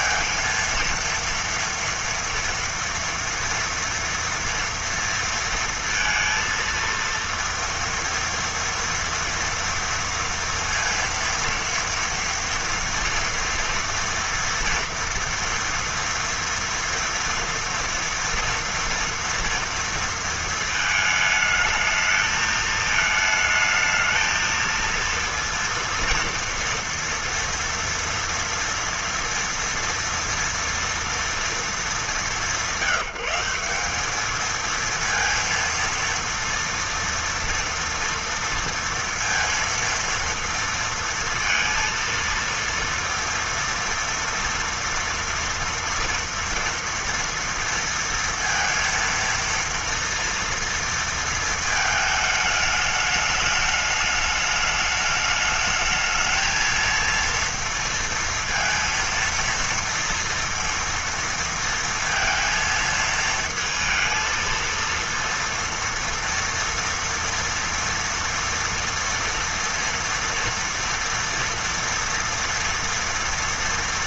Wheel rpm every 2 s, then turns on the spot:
230, 230, 230, 230, 230, 230, 230, 240, 230, 230, 230, 220, 230, 230, 230, 240, 190, 220, 230, 230, 230, 230, 230, 230, 230, 230, 210, 210, 230, 230, 230, 230, 230, 230, 230, 230, 230.
none